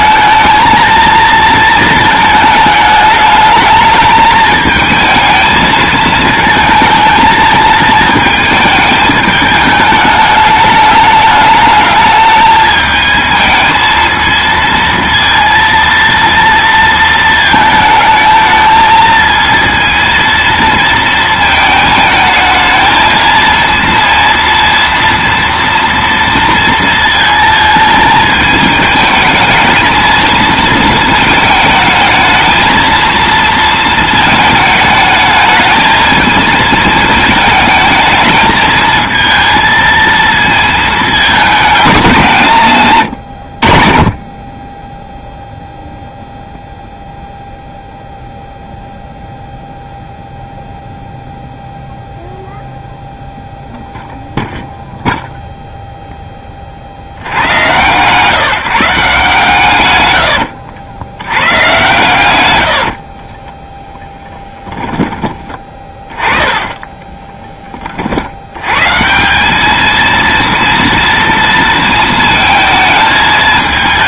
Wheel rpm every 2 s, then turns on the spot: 230, 210, 220, 220, 210, 210, 220, 230, 220, 220, 220, 220, 230, 230, 220, 220, 230, 220, 220, 220, 220, 90, 0, 0, 0, 0, 0, 0, 40, 160, 80, 70, 10, 20, 110, 230, 220.
62-68